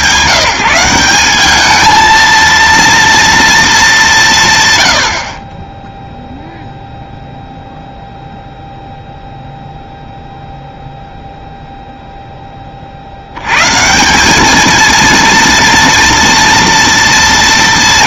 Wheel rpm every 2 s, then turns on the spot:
190, 230, 100, 0, 0, 0, 40, 230, 240.
none